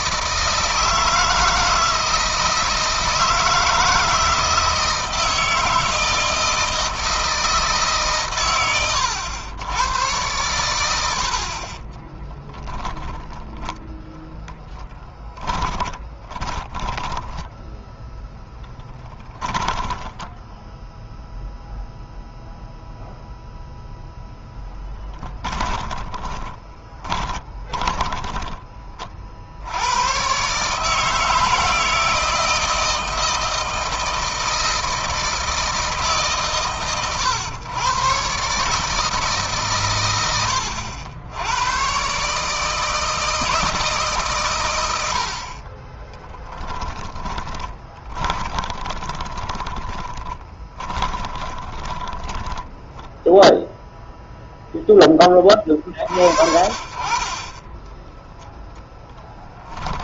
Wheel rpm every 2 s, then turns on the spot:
160, 160, 160, 160, 120, 100, 10, 10, 10, 10, 0, 0, 10, 20, 30, 150, 160, 160, 130, 150, 90, 160, 100, 10, 20, 20, 0, 10, 40, 0.
10-12 14-20 26-28 46-52